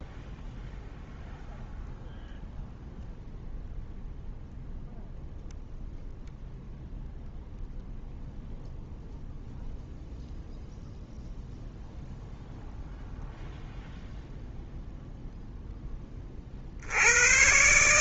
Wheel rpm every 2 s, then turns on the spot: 0, 0, 0, 0, 0, 0, 0, 0, 100.
none